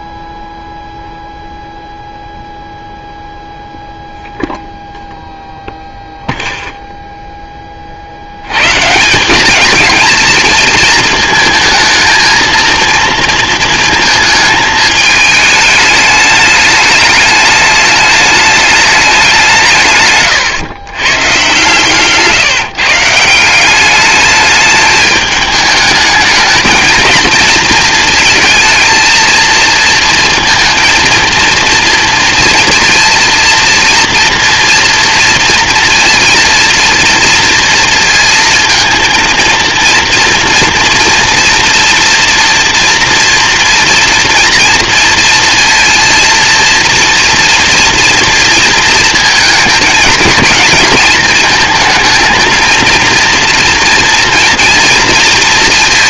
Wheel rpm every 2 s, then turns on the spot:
0, 0, 0, 0, 170, 230, 230, 210, 210, 210, 120, 150, 210, 220, 220, 230, 230, 230, 230, 230, 230, 230, 230, 240, 230, 220, 230, 230.
none